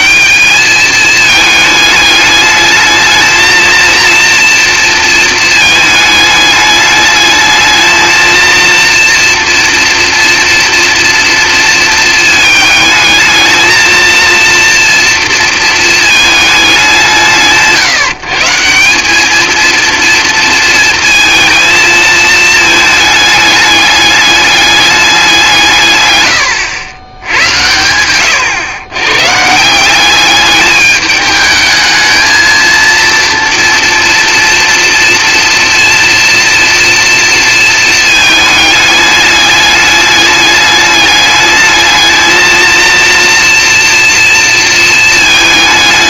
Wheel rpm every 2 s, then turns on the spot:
200, 210, 230, 210, 230, 230, 220, 230, 210, 160, 230, 220, 210, 100, 110, 200, 230, 230, 230, 220, 210, 220, 230.
none